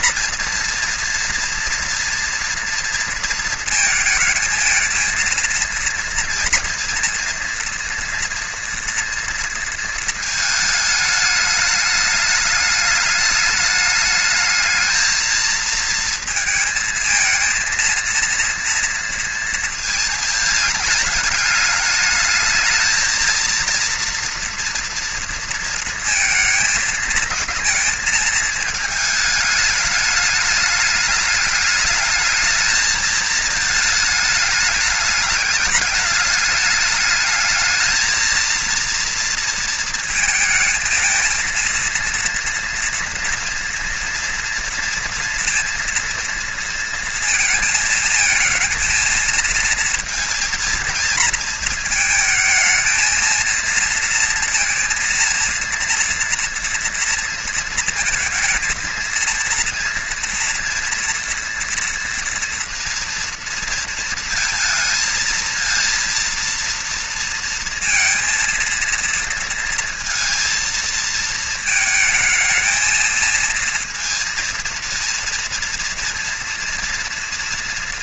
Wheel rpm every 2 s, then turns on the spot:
230, 230, 220, 230, 230, 220, 210, 220, 220, 230, 220, 220, 230, 230, 220, 210, 210, 210, 210, 220, 220, 230, 230, 230, 220, 220, 220, 230, 230, 230, 230, 230, 230, 230, 230, 220, 220, 230, 230.
none